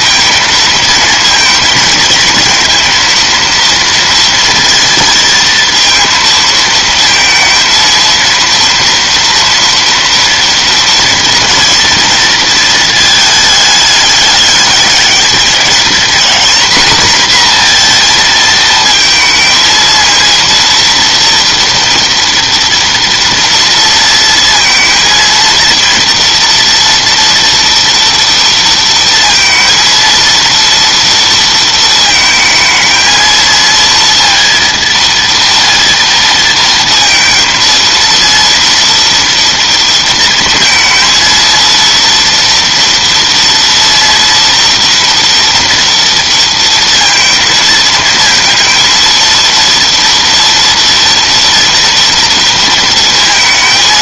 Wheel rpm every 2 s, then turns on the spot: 220, 230, 230, 220, 230, 230, 230, 210, 230, 230, 230, 230, 230, 230, 230, 230, 220, 230, 230, 230, 230, 230, 230, 230, 230, 240, 230.
none